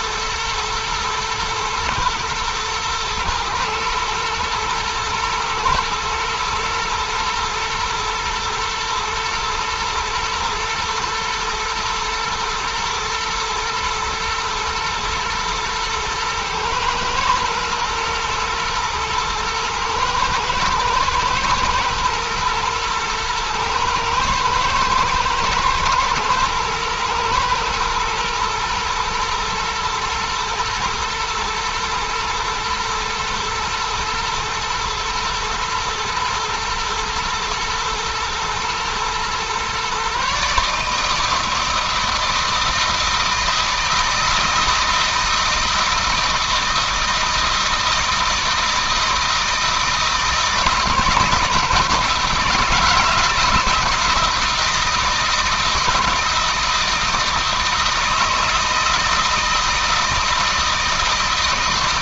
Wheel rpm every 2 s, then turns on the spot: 110, 110, 110, 110, 120, 120, 120, 110, 110, 110, 120, 120, 110, 120, 120, 120, 110, 120, 110, 120, 150, 160, 160, 160, 160, 160, 160, 160, 160, 160, 160.
none